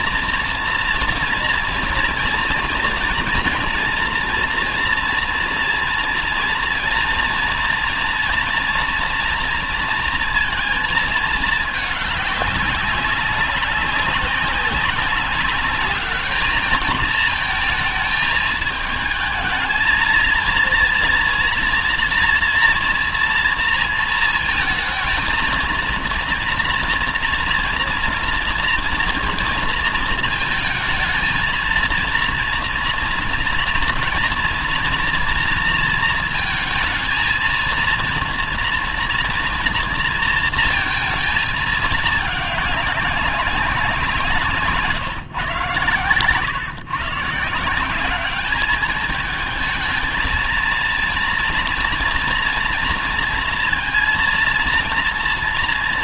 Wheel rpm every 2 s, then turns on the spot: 230, 240, 230, 230, 240, 230, 200, 190, 210, 220, 230, 230, 220, 230, 230, 230, 230, 230, 220, 230, 230, 200, 160, 130, 200, 230, 240, 230.
none